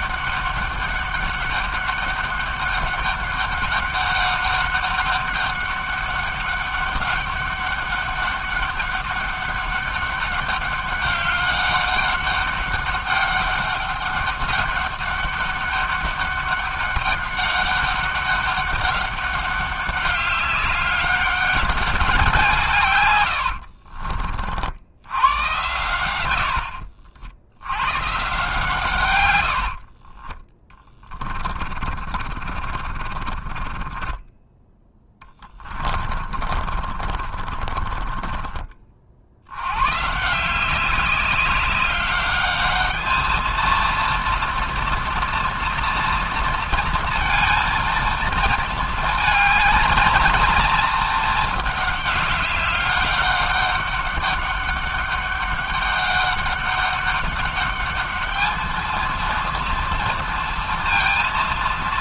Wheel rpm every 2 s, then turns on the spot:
200, 200, 200, 200, 200, 200, 200, 200, 200, 200, 200, 150, 70, 60, 150, 20, 40, 10, 30, 30, 170, 210, 230, 230, 220, 230, 200, 200, 200, 220, 230.
26-28 32-34 36-40